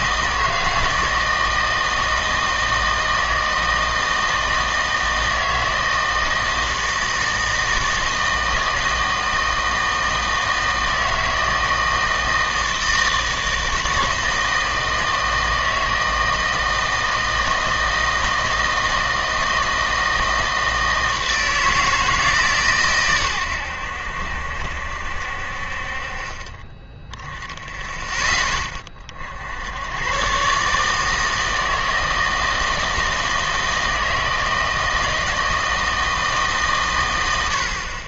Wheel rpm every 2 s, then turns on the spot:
160, 160, 160, 160, 160, 160, 160, 160, 160, 160, 160, 140, 70, 20, 20, 140, 160, 160, 140.
none